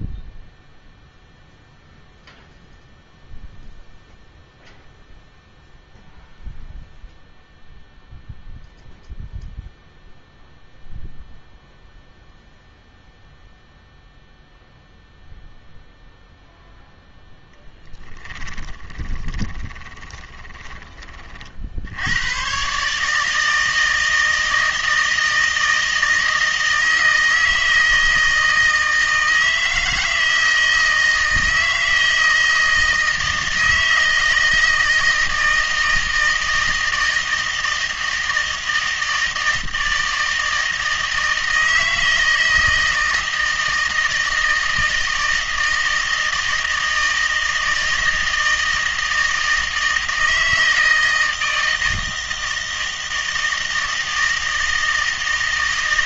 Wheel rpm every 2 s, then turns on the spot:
0, 0, 0, 0, 0, 0, 0, 0, 0, 20, 20, 130, 160, 160, 160, 160, 160, 160, 160, 160, 160, 160, 160, 160, 160, 160, 160, 160.
18-20